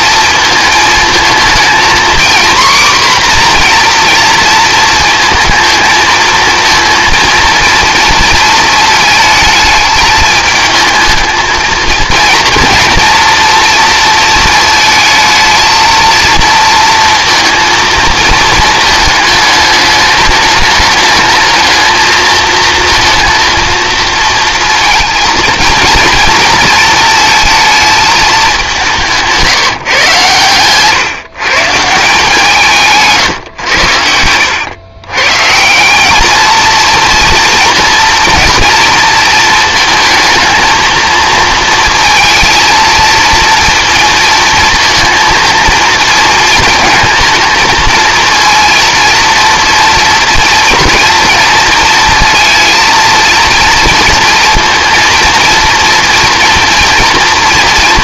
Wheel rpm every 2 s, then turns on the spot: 220, 250, 230, 230, 220, 220, 230, 220, 230, 220, 210, 230, 230, 220, 180, 130, 150, 110, 230, 230, 230, 230, 230, 230, 230, 230, 230, 230, 230.
none